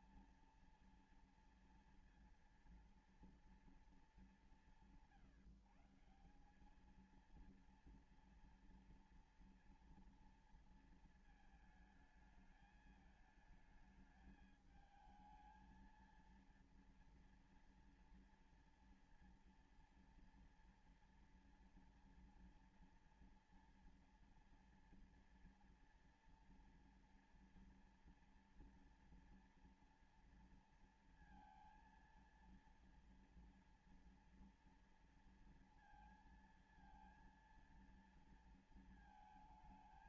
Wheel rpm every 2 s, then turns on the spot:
230, 230, 180, 190, 230, 230, 210, 220, 230, 230, 240, 230, 230, 230, 230, 230, 230, 230, 230, 230.
none